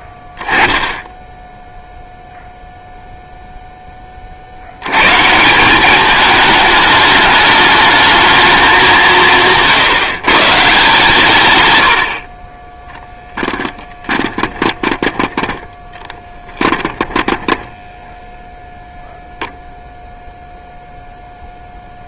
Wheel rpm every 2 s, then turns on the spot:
10, 0, 80, 210, 210, 150, 20, 10, 10, 0, 0.
14-18